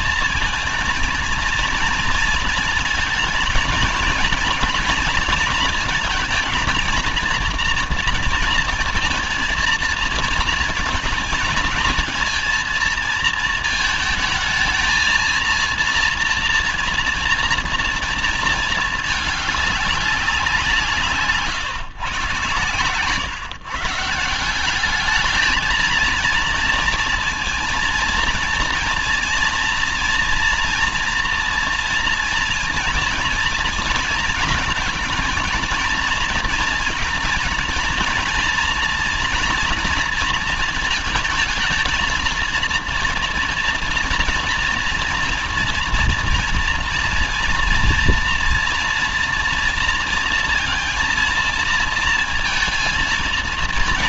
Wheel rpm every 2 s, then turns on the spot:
230, 230, 230, 230, 230, 220, 230, 230, 230, 210, 160, 130, 210, 230, 230, 230, 230, 230, 230, 230, 220, 230, 240, 230, 230, 230, 230.
20-22